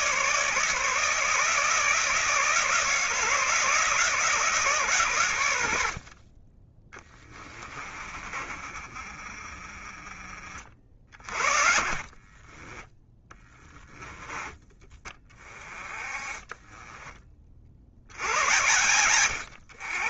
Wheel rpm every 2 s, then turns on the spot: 150, 160, 130, 20, 30, 50, 10, 20, 20, 110.
6-14